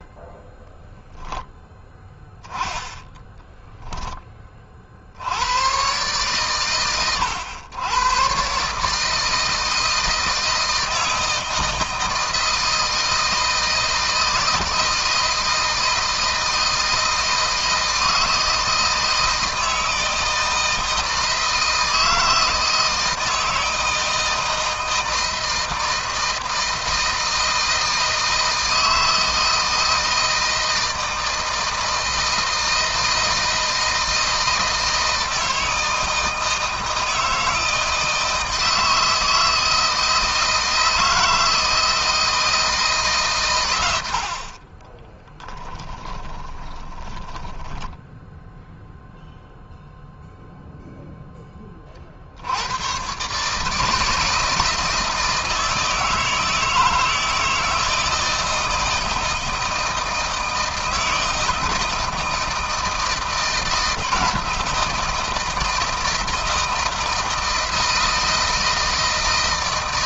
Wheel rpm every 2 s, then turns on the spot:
0, 10, 60, 110, 150, 160, 160, 160, 160, 160, 160, 160, 160, 160, 160, 160, 160, 160, 160, 160, 160, 150, 20, 20, 0, 0, 120, 160, 160, 160, 160, 160, 160, 160, 160.
44-48